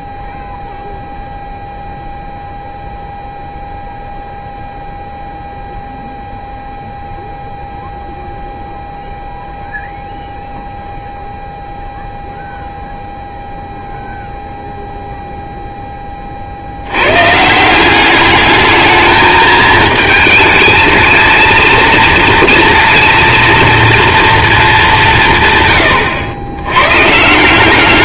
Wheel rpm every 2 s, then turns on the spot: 0, 0, 0, 0, 0, 0, 0, 0, 50, 210, 220, 230, 220, 100.
none